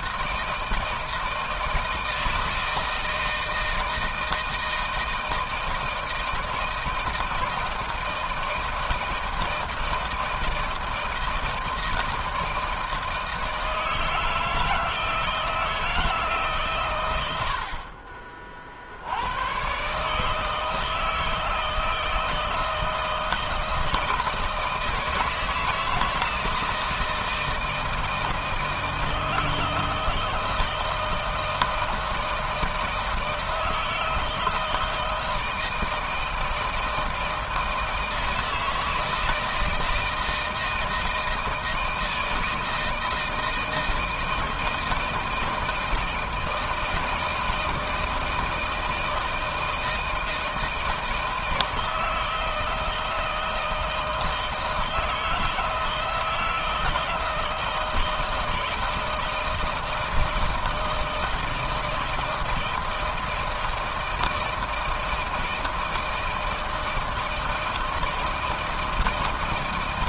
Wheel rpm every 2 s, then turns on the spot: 160, 160, 160, 160, 160, 160, 160, 160, 150, 40, 150, 160, 160, 160, 160, 160, 160, 160, 160, 160, 160, 160, 160, 160, 160, 160, 160, 160, 160, 160, 160, 160, 160, 160, 160.
none